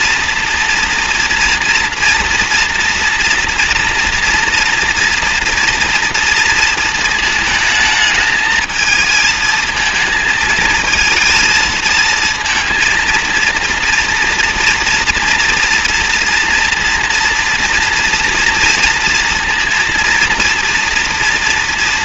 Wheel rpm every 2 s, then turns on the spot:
230, 230, 230, 220, 220, 220, 230, 230, 230, 230, 230.
none